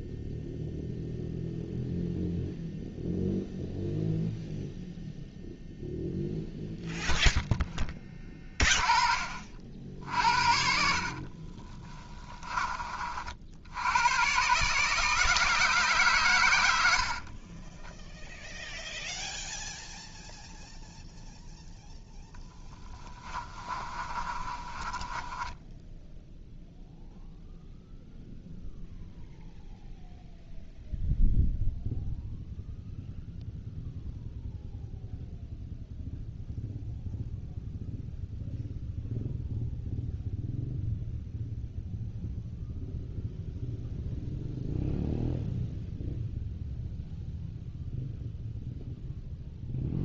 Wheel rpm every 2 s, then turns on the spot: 0, 0, 0, 0, 30, 50, 30, 150, 80, 0, 0, 20, 20, 0, 0, 0, 0, 0, 0, 0, 0, 0, 0, 0, 0.
10-12 22-26